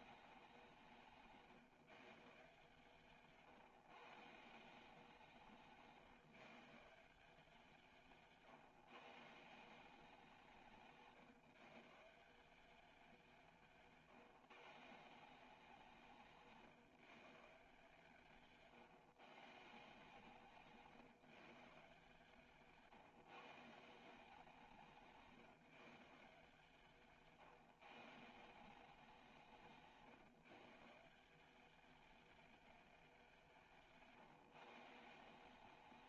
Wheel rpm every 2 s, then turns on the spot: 170, 150, 170, 160, 140, 160, 190, 160, 150, 140, 150, 160, 170, 160, 180, 150, 210, 150.
20-22